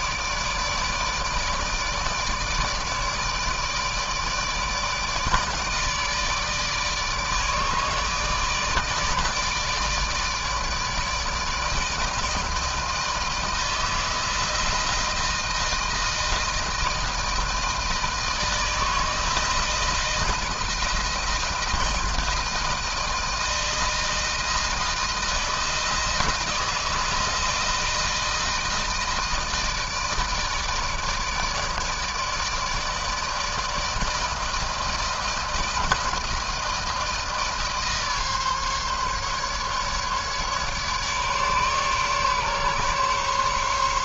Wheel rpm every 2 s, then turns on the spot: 150, 150, 160, 150, 150, 150, 160, 170, 160, 160, 160, 160, 160, 160, 160, 150, 160, 160, 160, 150, 150, 140.
none